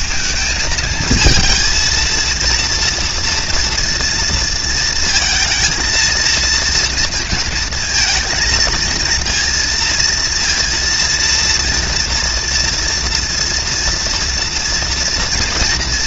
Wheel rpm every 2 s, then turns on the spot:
220, 230, 230, 230, 230, 230, 240, 230.
none